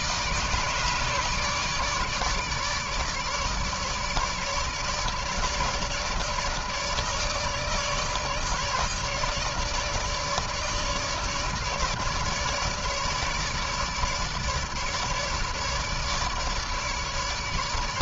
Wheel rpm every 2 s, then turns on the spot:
150, 150, 150, 150, 150, 150, 150, 150, 150.
none